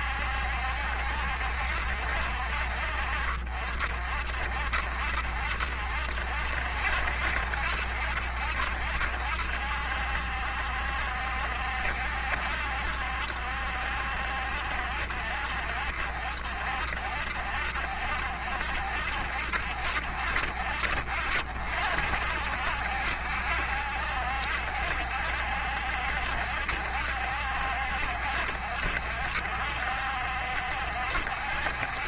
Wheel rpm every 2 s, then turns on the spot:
70, 60, 60, 70, 70, 70, 70, 70, 70, 70, 60, 70, 70, 70, 70, 70.
none